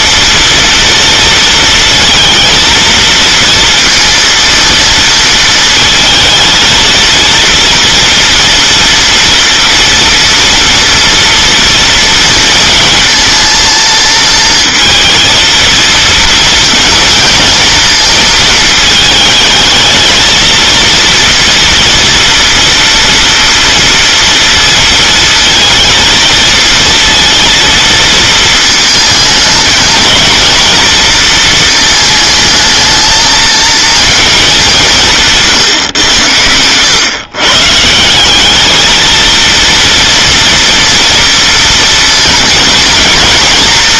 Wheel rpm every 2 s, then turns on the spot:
230, 230, 230, 230, 240, 230, 230, 230, 230, 220, 230, 230, 230, 220, 220, 230, 220, 190, 100, 220, 230, 230.
none